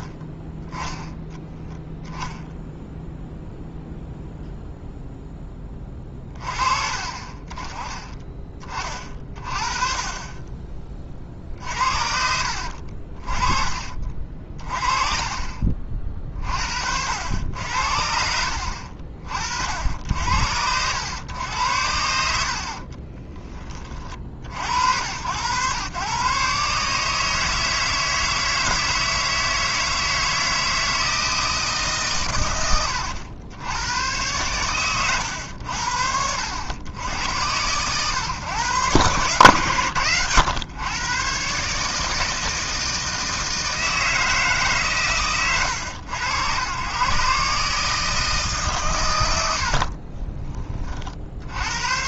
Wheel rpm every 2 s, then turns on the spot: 0, 0, 0, 30, 30, 30, 50, 40, 60, 60, 90, 50, 80, 150, 160, 160, 100, 110, 90, 120, 110, 160, 140, 120, 130, 30.
12-14 22-24 32-34